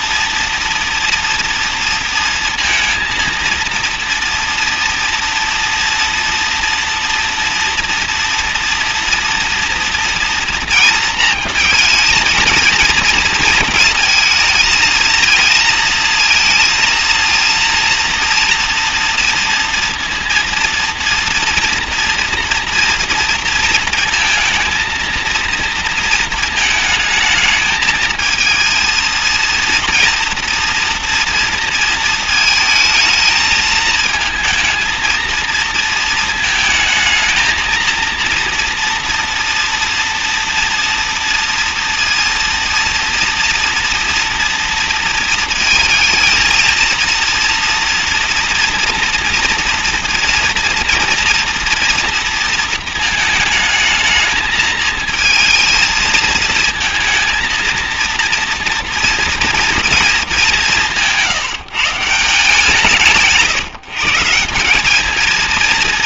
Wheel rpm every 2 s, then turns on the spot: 230, 230, 230, 230, 230, 230, 230, 230, 230, 230, 230, 230, 230, 220, 220, 230, 220, 220, 230, 230, 230, 230, 230, 230, 230, 230, 230, 220, 220, 230, 210, 160, 180.
none